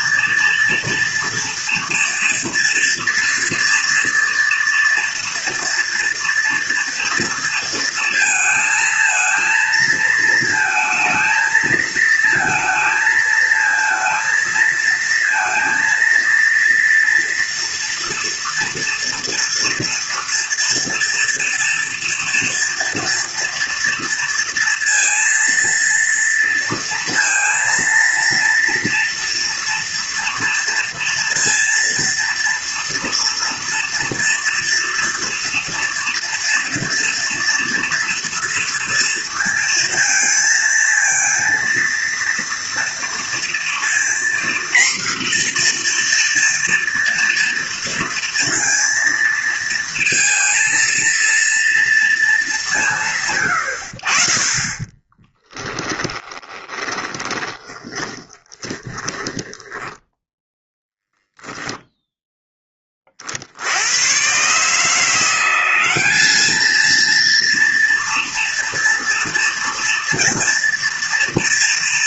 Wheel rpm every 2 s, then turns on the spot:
230, 230, 240, 230, 220, 220, 220, 230, 230, 230, 230, 230, 230, 230, 230, 230, 230, 230, 240, 230, 230, 230, 240, 230, 230, 230, 190, 20, 20, 20, 0, 20, 150, 220, 230, 230.
54-60